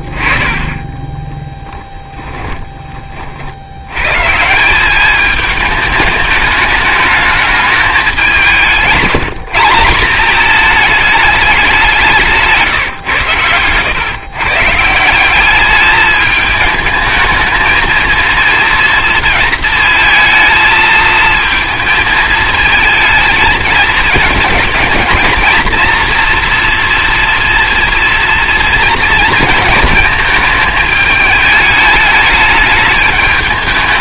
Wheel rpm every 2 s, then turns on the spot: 40, 20, 180, 210, 170, 210, 150, 150, 210, 230, 220, 220, 210, 240, 230, 220, 210.
12-14